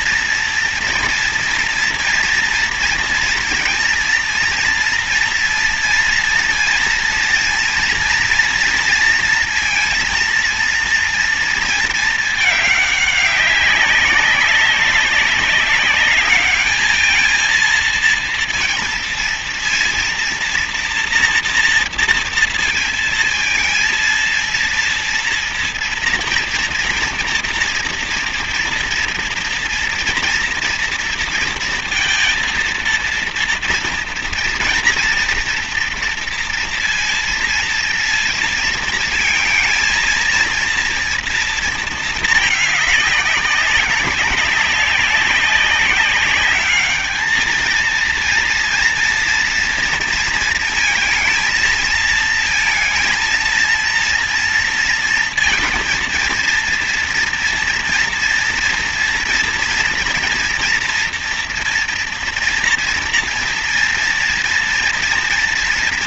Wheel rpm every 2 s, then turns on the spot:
240, 230, 230, 230, 230, 230, 210, 200, 210, 230, 230, 230, 230, 230, 240, 230, 230, 230, 230, 230, 230, 210, 190, 210, 230, 230, 230, 230, 230, 230, 230, 230, 230.
none